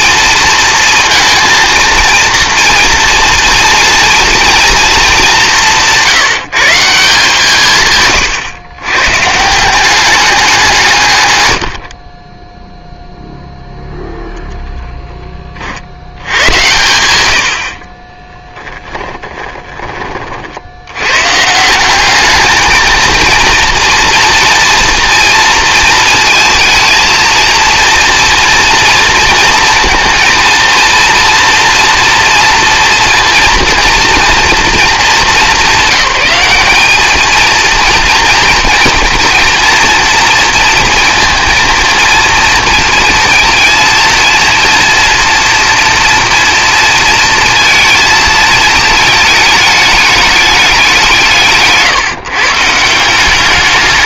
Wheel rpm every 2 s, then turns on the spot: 230, 240, 230, 170, 120, 160, 0, 10, 100, 20, 100, 220, 230, 220, 230, 230, 240, 220, 210, 240, 230, 230, 230, 230, 210, 180, 170.
18-20